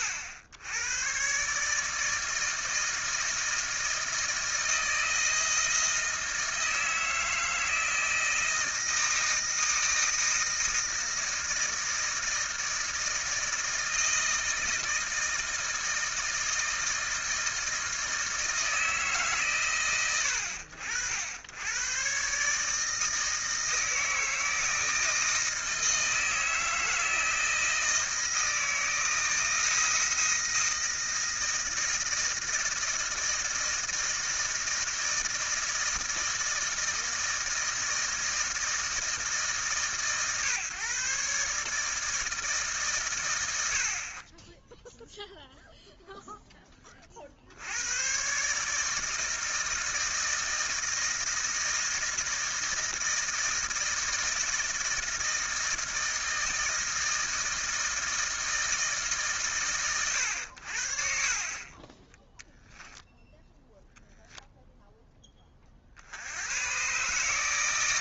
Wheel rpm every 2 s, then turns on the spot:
100, 160, 160, 160, 160, 160, 160, 160, 160, 160, 80, 150, 160, 160, 160, 160, 160, 160, 160, 160, 140, 140, 10, 40, 150, 160, 160, 160, 160, 160, 60, 0, 0, 120.
none